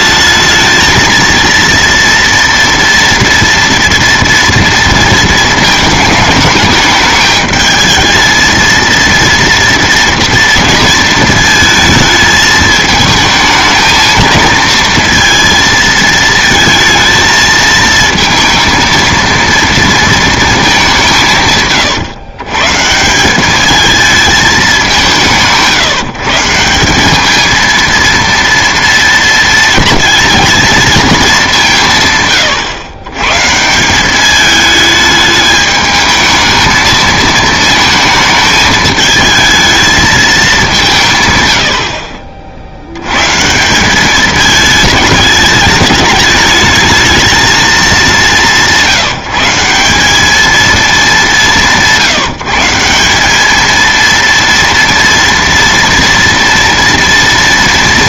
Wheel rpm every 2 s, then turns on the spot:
220, 230, 230, 210, 230, 230, 220, 220, 220, 230, 190, 150, 190, 190, 230, 220, 110, 210, 220, 220, 160, 100, 210, 220, 170, 210, 180, 230, 230.
none